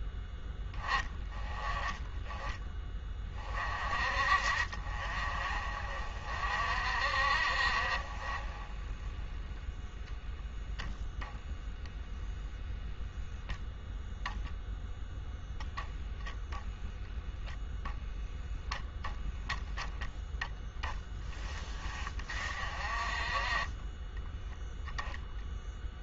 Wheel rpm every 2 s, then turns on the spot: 10, 20, 50, 50, 40, 0, 0, 0, 0, 10, 10, 40, 10.
none